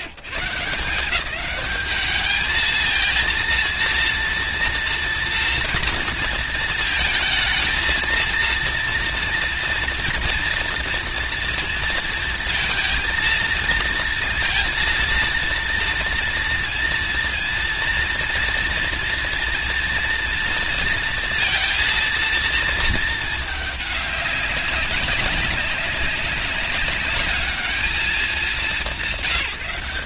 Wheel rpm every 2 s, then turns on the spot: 90, 210, 230, 230, 230, 230, 230, 230, 230, 230, 230, 230, 200, 200, 200.
none